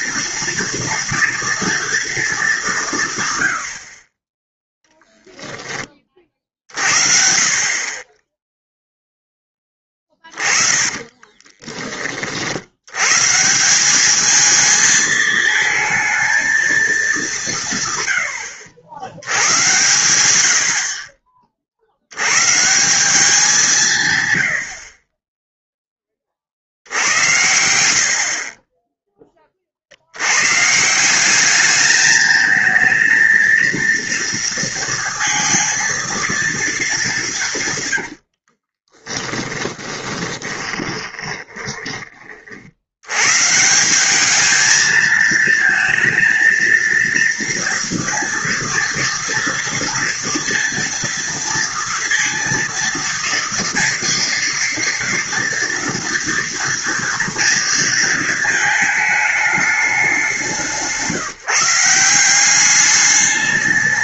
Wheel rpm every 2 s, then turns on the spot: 230, 190, 10, 50, 0, 20, 80, 220, 220, 90, 60, 150, 70, 60, 20, 150, 220, 230, 220, 40, 20, 60, 220, 230, 230, 230, 230, 230, 240, 220, 170, 200.
10-12 38-42